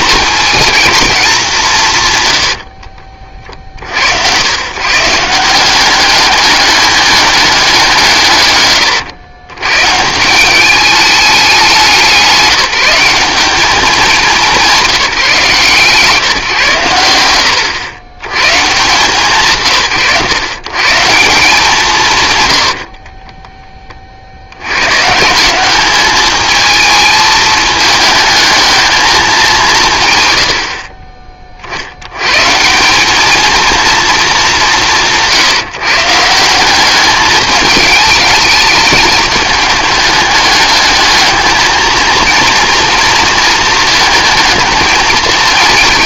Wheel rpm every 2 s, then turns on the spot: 210, 50, 120, 200, 120, 200, 190, 190, 120, 140, 140, 80, 100, 220, 220, 70, 170, 200, 190, 210, 210, 230, 220.
2-4 22-24